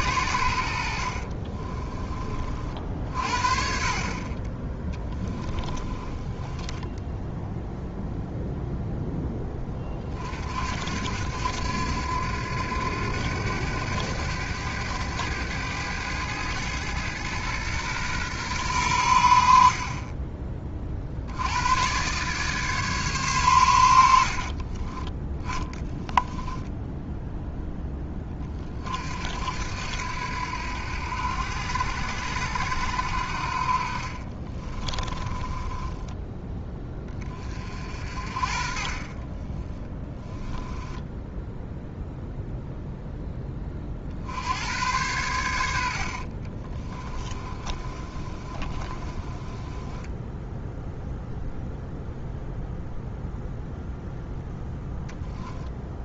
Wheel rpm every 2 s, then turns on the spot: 50, 50, 20, 0, 10, 80, 100, 100, 110, 100, 70, 140, 20, 0, 60, 80, 60, 20, 20, 20, 10, 10, 110, 20, 20, 0, 0, 0.
0-2 4-6 24-26 34-36 38-42 46-50